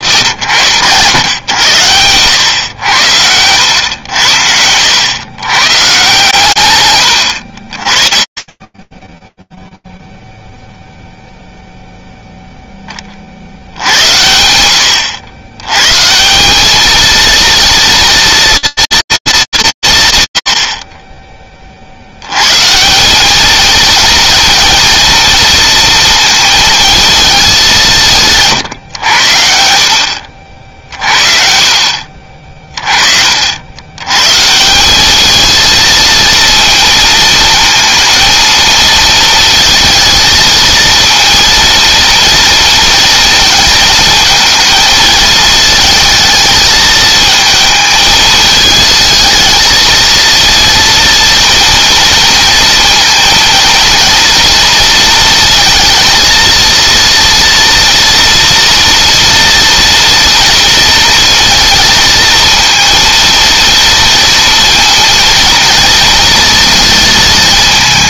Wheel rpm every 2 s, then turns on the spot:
110, 90, 90, 100, 10, 0, 20, 90, 220, 240, 100, 150, 230, 220, 130, 60, 40, 200, 230, 230, 230, 220, 220, 220, 220, 230, 230, 230, 230, 230, 230, 230, 230, 230.
none